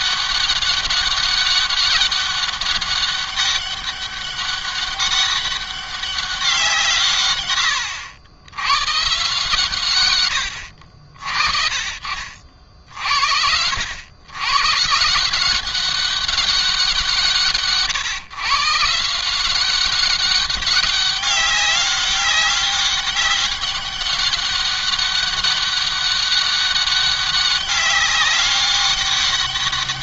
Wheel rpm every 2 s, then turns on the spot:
200, 200, 200, 180, 110, 100, 60, 120, 190, 150, 200, 200, 200, 200, 200.
none